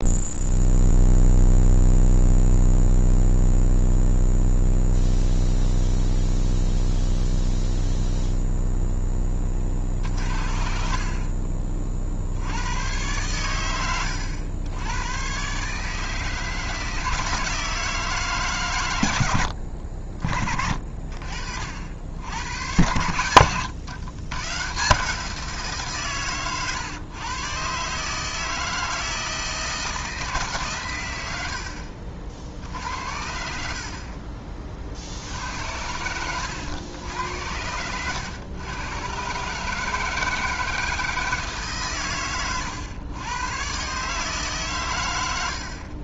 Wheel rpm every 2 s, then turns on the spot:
0, 0, 0, 0, 0, 50, 90, 90, 160, 150, 50, 90, 130, 130, 160, 140, 60, 40, 100, 110, 160, 120, 140.
none